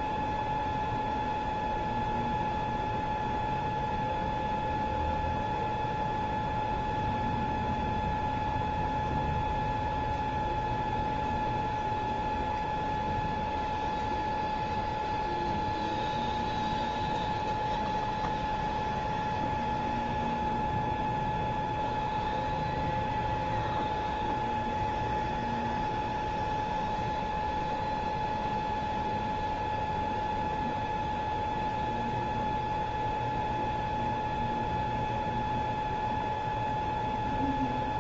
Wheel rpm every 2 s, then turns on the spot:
0, 0, 0, 0, 0, 0, 0, 0, 0, 0, 0, 0, 0, 0, 0, 0, 0, 0, 0.
none